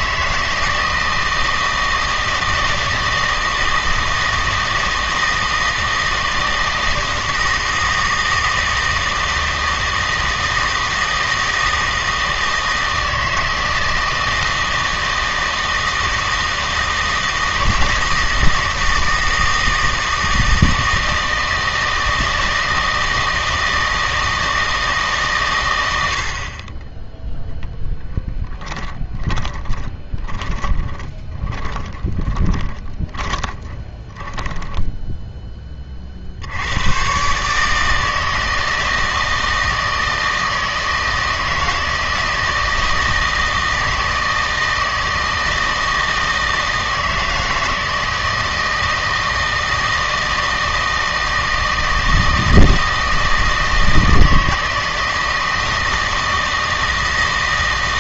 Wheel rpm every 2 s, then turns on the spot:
160, 160, 160, 160, 160, 160, 160, 160, 160, 160, 160, 160, 160, 20, 10, 10, 20, 10, 100, 160, 160, 160, 160, 160, 160, 160, 160, 160, 160.
30-36